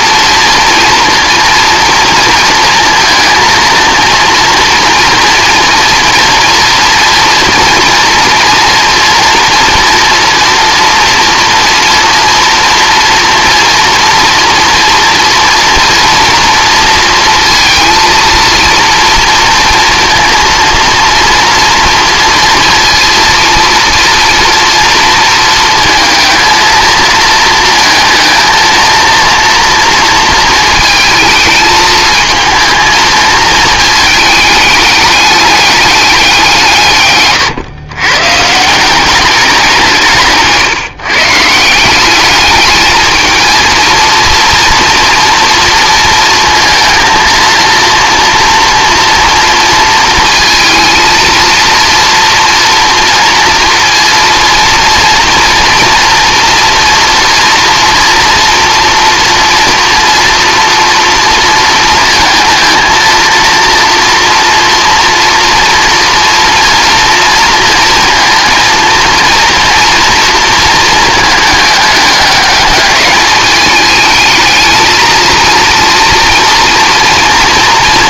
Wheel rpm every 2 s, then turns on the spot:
230, 230, 230, 230, 230, 230, 230, 230, 230, 230, 230, 230, 230, 220, 230, 220, 220, 210, 160, 170, 160, 210, 230, 230, 240, 230, 230, 230, 230, 240, 230, 220, 230, 230, 230, 230, 210, 220, 240.
none